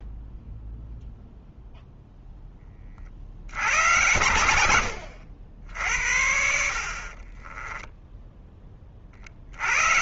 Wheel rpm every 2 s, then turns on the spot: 0, 40, 90, 70, 30.
6-8